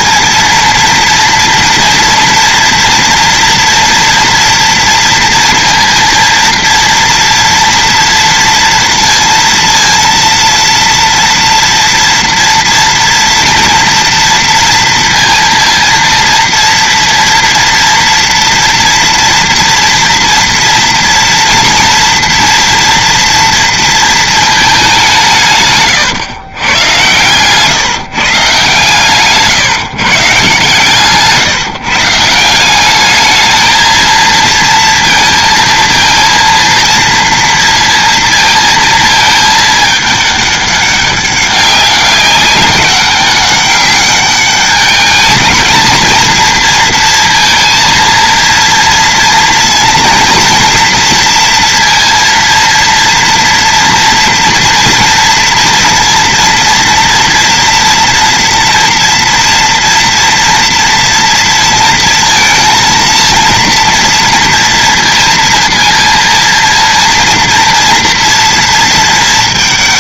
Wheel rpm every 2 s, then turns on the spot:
230, 230, 230, 230, 230, 230, 230, 230, 230, 240, 230, 230, 210, 120, 140, 140, 190, 230, 230, 230, 200, 200, 210, 230, 230, 230, 230, 230, 230, 230, 240, 230, 230, 230, 230.
30-32